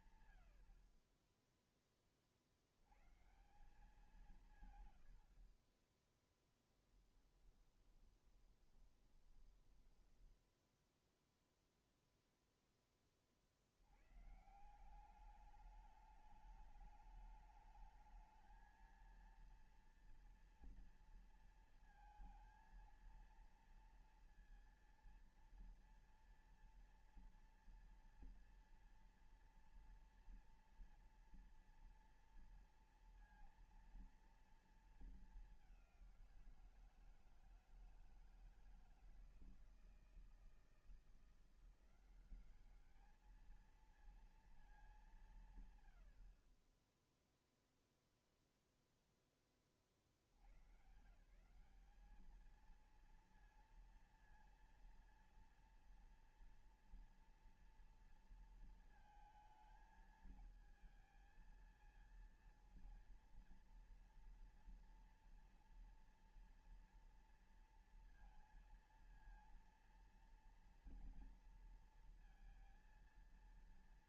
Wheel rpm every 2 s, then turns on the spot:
110, 60, 160, 30, 20, 10, 0, 130, 200, 220, 230, 230, 230, 230, 230, 240, 230, 230, 180, 160, 160, 190, 220, 60, 0, 70, 200, 230, 230, 230, 220, 230, 230, 230, 230, 230, 230.
8-12